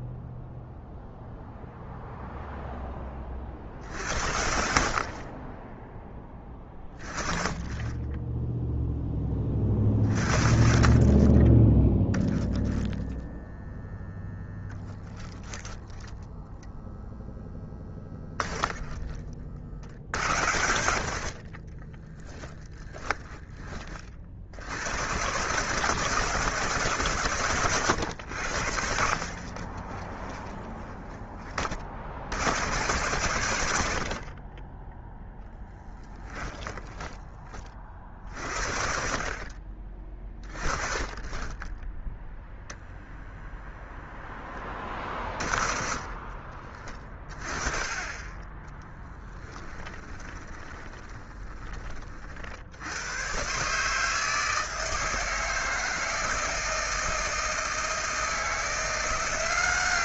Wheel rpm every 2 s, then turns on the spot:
0, 10, 50, 20, 10, 30, 10, 10, 0, 20, 70, 10, 100, 150, 70, 20, 110, 20, 10, 60, 20, 0, 20, 30, 10, 20, 90, 160, 160, 170.
22-24 34-38 48-52